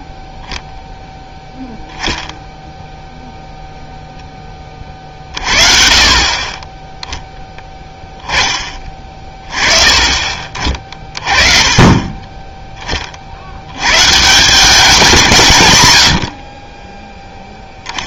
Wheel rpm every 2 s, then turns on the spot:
0, 0, 20, 20, 20, 40, 20, 180, 40.
none